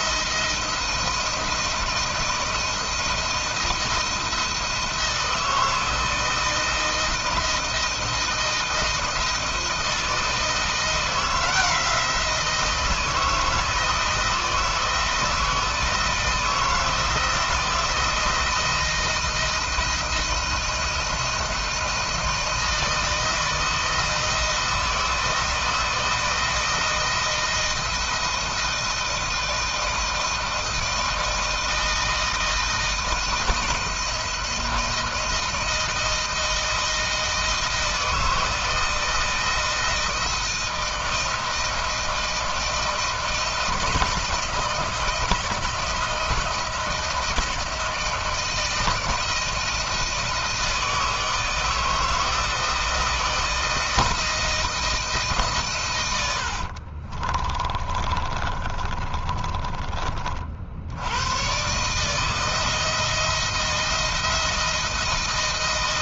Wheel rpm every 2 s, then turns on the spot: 170, 160, 170, 160, 170, 170, 170, 160, 160, 170, 160, 170, 160, 160, 170, 160, 160, 160, 160, 160, 160, 160, 160, 160, 160, 160, 160, 160, 80, 30, 50, 160, 160.
56-60